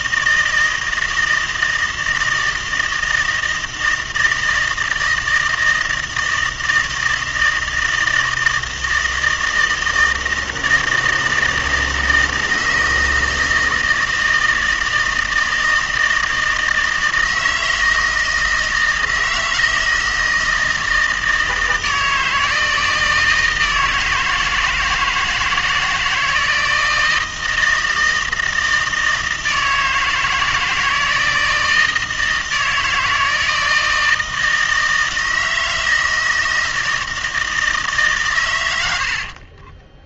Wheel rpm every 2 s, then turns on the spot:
160, 160, 160, 160, 160, 160, 160, 160, 160, 160, 160, 160, 160, 160, 160, 160, 160, 160, 160, 100.
38-40